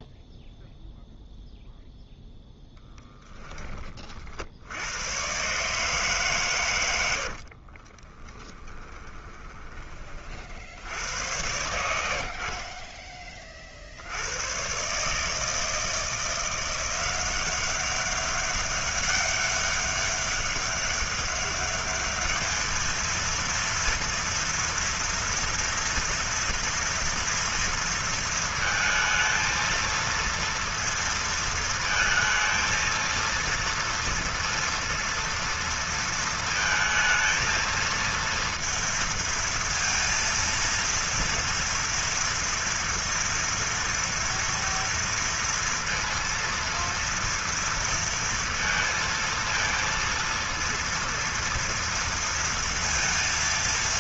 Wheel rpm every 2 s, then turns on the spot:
0, 0, 60, 140, 30, 50, 50, 100, 170, 200, 200, 210, 230, 230, 230, 230, 220, 230, 230, 230, 230, 230, 230, 230, 230, 230, 230.
8-10